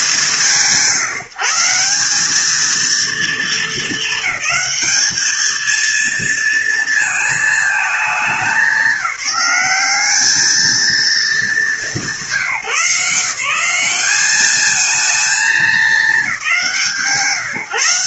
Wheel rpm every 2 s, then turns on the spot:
150, 230, 220, 220, 200, 220, 170, 220, 150.
none